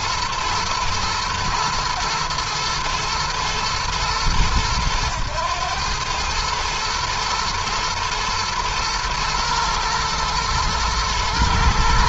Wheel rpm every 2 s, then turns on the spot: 120, 110, 110, 110, 110, 120.
none